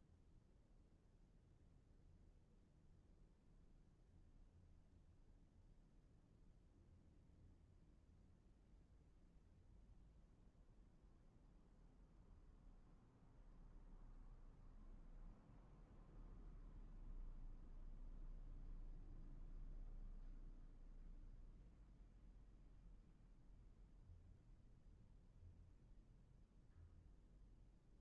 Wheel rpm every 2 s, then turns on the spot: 0, 0, 0, 0, 0, 0, 0, 0, 0, 0, 0, 0, 0, 0.
none